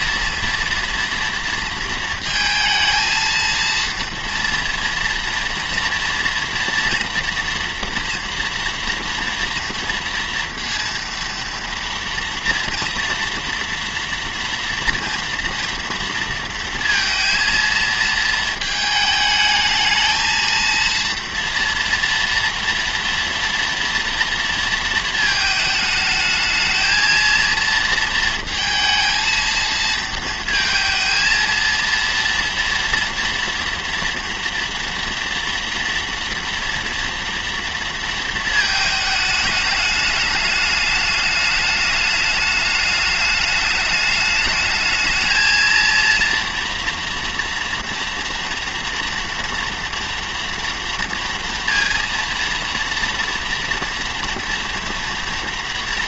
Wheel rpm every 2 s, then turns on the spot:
240, 220, 230, 230, 230, 230, 240, 230, 230, 220, 230, 230, 230, 220, 220, 230, 230, 230, 230, 220, 210, 210, 210, 240, 230, 230, 230, 240.
none